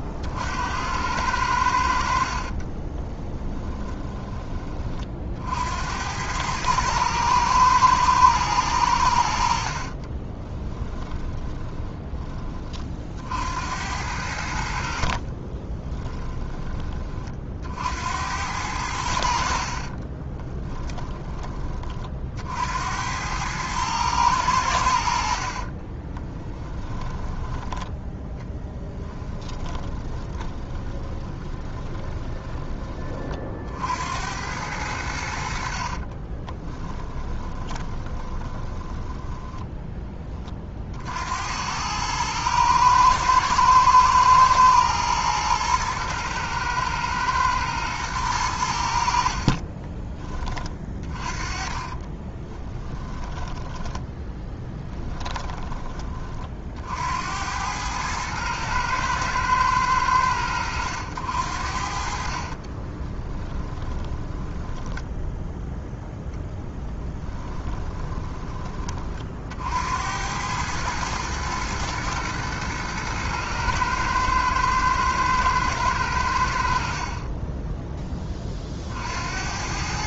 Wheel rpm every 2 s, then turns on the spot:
70, 40, 30, 110, 100, 20, 40, 60, 30, 90, 20, 70, 90, 10, 10, 30, 20, 90, 20, 10, 40, 110, 110, 110, 80, 30, 20, 10, 60, 110, 90, 40, 10, 10, 20, 110, 110, 110, 60, 40.
2-4 10-12 20-22 26-32 36-40 50-56 62-66